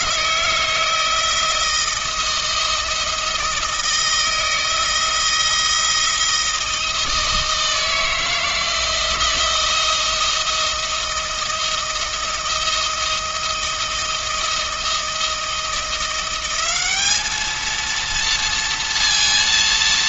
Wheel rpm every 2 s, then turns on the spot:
160, 160, 160, 160, 160, 160, 170, 160, 200, 230.
none